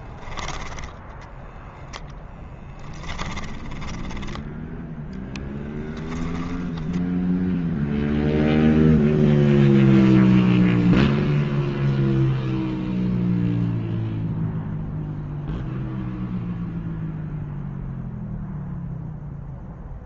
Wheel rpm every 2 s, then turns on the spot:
10, 10, 10, 20, 0, 0, 0, 0, 0, 0.
2-8